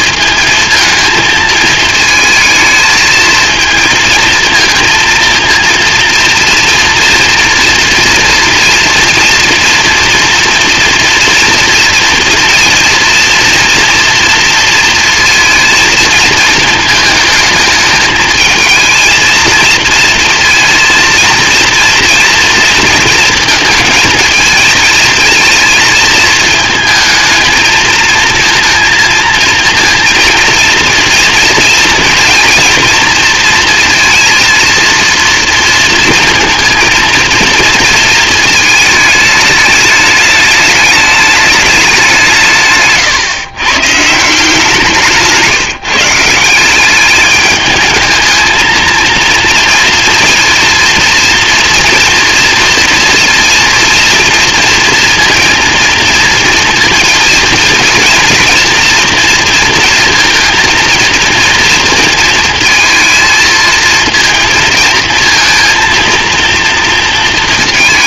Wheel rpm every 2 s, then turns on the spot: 230, 220, 230, 230, 240, 230, 240, 230, 220, 220, 230, 230, 230, 220, 230, 230, 230, 230, 230, 220, 210, 130, 160, 200, 230, 230, 230, 230, 230, 230, 230, 230, 230, 230.
none